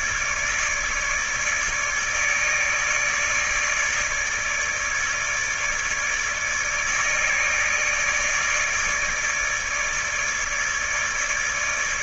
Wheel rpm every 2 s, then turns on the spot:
150, 150, 150, 150, 150, 160.
none